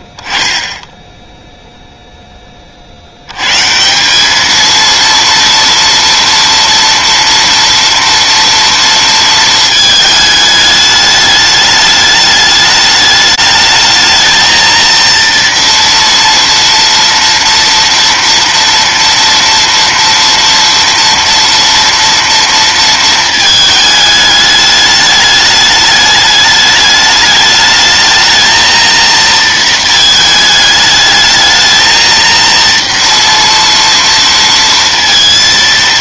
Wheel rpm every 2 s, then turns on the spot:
10, 30, 230, 230, 230, 210, 210, 230, 230, 230, 230, 230, 210, 210, 230, 220, 230, 230.
none